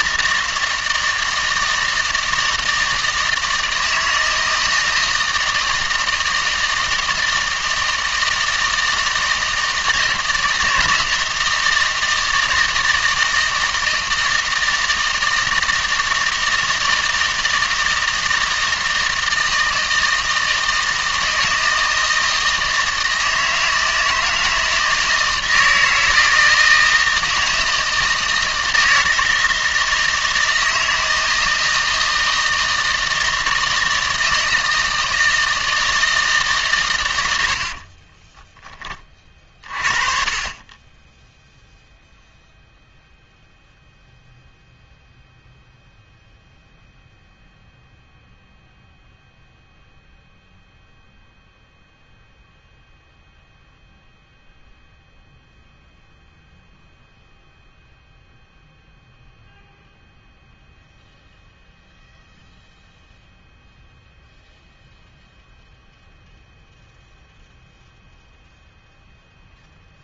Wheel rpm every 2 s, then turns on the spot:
160, 160, 160, 160, 160, 160, 160, 160, 160, 160, 160, 160, 160, 160, 160, 160, 160, 160, 140, 10, 20, 0, 0, 0, 0, 0, 0, 0, 0, 0, 0, 0, 0, 0, 0.
none